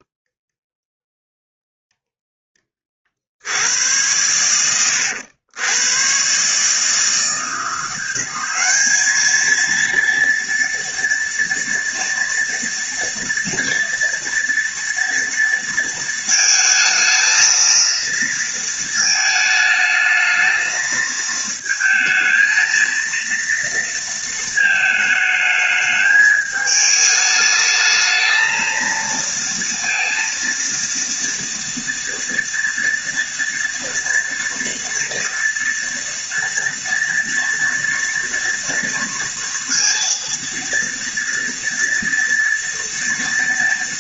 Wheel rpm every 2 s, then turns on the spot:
0, 40, 90, 150, 210, 230, 230, 230, 220, 220, 220, 230, 220, 210, 230, 230, 230, 240, 230, 230, 230, 230.
none